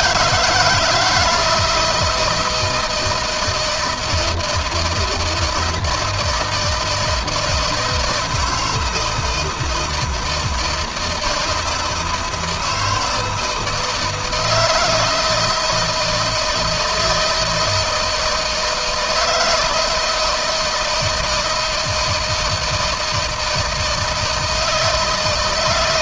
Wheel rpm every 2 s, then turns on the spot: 170, 160, 160, 160, 160, 160, 160, 160, 160, 160, 170, 160, 160.
none